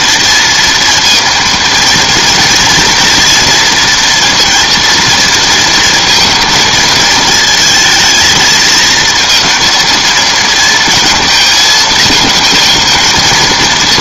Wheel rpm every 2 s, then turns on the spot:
230, 230, 230, 220, 220, 220, 220.
none